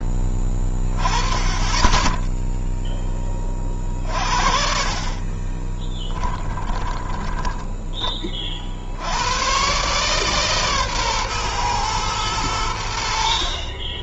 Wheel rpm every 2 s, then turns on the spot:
20, 0, 40, 20, 30, 140, 100.
6-8